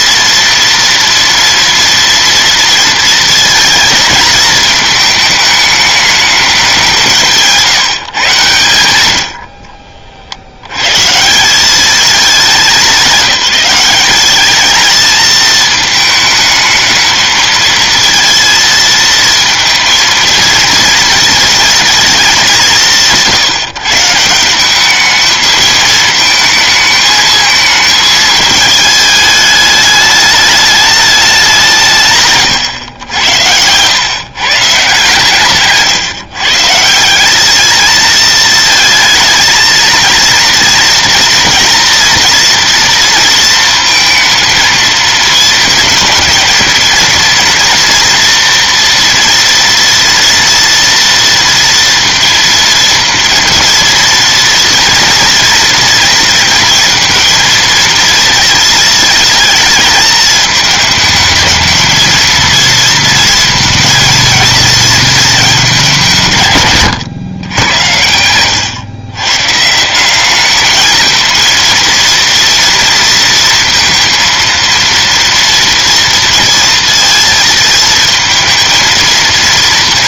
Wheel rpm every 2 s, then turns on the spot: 230, 230, 220, 190, 100, 110, 190, 210, 220, 220, 230, 170, 200, 220, 220, 210, 110, 130, 170, 220, 230, 230, 230, 230, 230, 230, 230, 230, 230, 220, 220, 230, 220, 130, 110, 220, 230, 230, 230, 230.
none